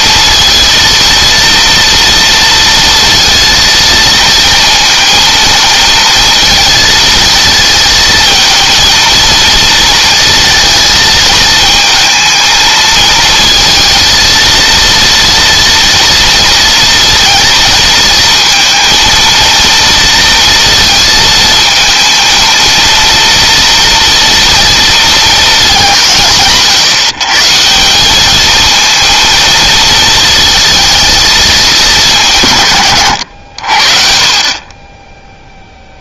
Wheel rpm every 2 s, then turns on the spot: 230, 230, 220, 220, 230, 230, 220, 230, 230, 230, 230, 230, 230, 150, 220, 220, 140, 40.
none